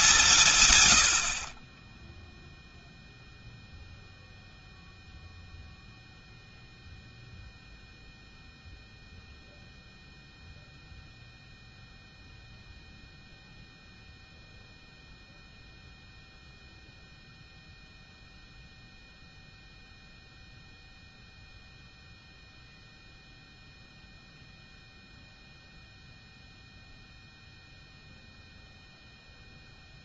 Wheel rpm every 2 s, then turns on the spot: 140, 0, 0, 0, 0, 0, 0, 0, 0, 0, 0, 0, 0, 0, 0.
none